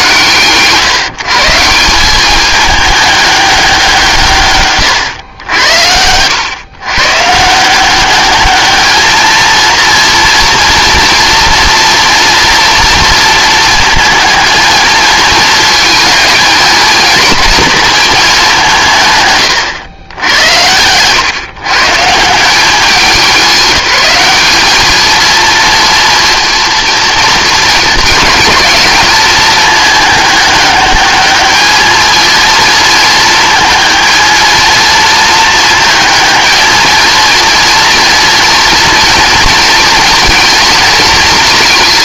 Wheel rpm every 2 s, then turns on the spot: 150, 210, 120, 120, 220, 230, 230, 220, 220, 170, 100, 190, 210, 230, 210, 210, 220, 230, 220, 230, 220.
none